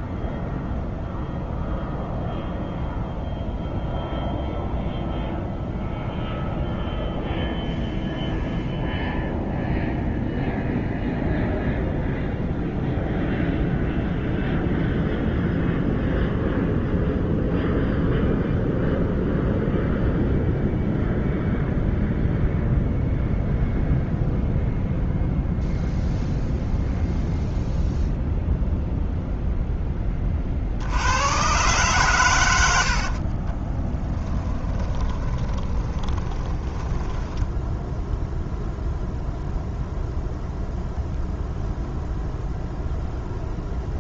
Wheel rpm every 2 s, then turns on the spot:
0, 0, 0, 0, 0, 0, 0, 0, 0, 0, 0, 0, 0, 0, 0, 70, 70, 20, 10, 0, 0, 0.
32-38